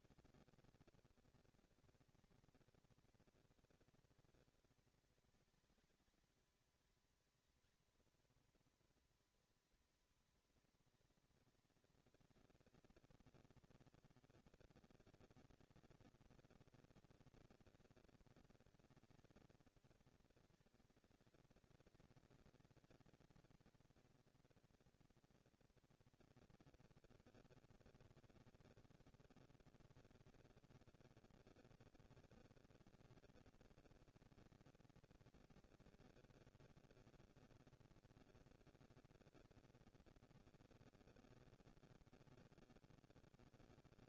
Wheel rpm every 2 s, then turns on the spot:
230, 230, 210, 210, 230, 220, 220, 230, 240, 230, 230, 220, 220, 230, 230, 230, 230, 230, 230, 230, 230, 170.
none